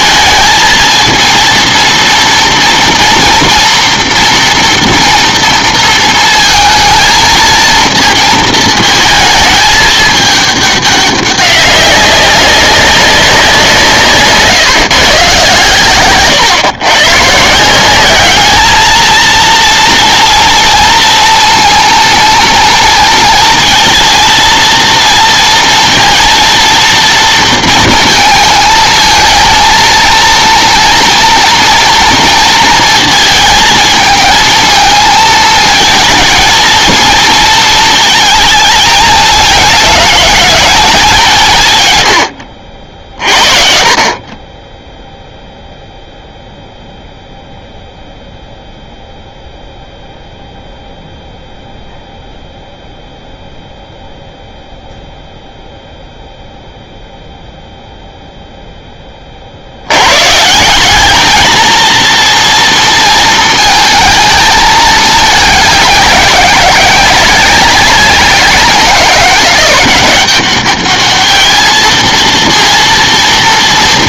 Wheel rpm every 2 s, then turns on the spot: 220, 230, 230, 230, 220, 210, 200, 150, 130, 210, 230, 230, 230, 230, 220, 230, 230, 220, 230, 220, 210, 60, 20, 0, 0, 0, 0, 0, 0, 0, 160, 230, 220, 190, 190, 200, 230.
none